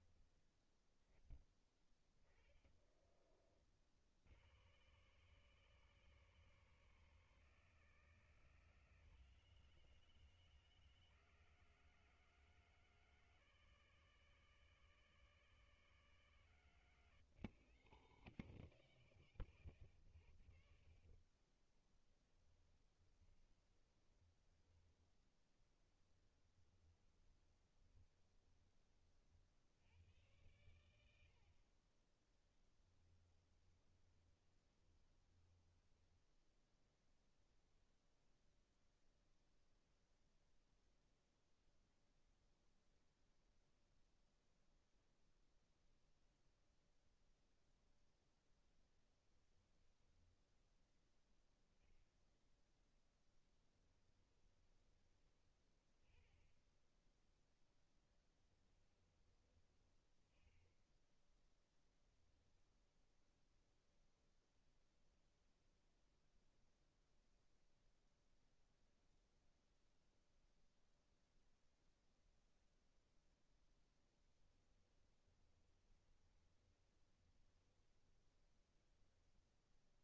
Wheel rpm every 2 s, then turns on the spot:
10, 30, 110, 140, 120, 140, 150, 150, 150, 140, 50, 10, 10, 10, 20, 90, 20, 20, 10, 0, 0, 0, 0, 0, 10, 0, 0, 10, 10, 10, 10, 0, 0, 0, 0, 0, 0, 10, 20, 10.
2-4 22-24 26-28 32-36 74-80